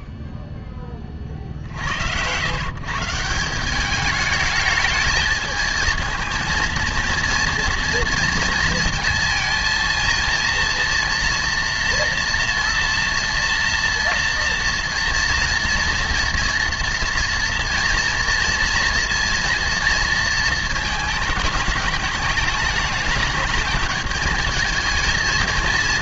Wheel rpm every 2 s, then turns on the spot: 10, 130, 210, 230, 230, 230, 230, 230, 230, 230, 220, 210, 220.
none